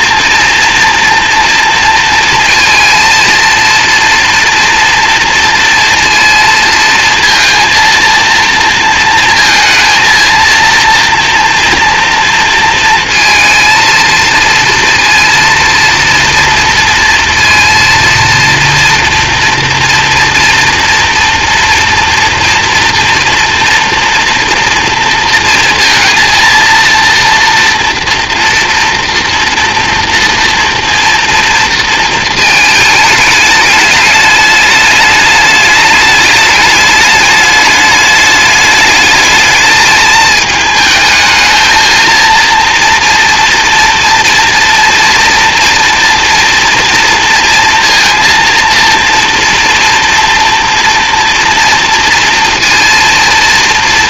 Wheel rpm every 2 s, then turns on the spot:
230, 230, 230, 230, 230, 230, 230, 230, 230, 230, 230, 230, 230, 230, 230, 230, 220, 210, 210, 210, 220, 230, 230, 230, 230, 230, 230.
none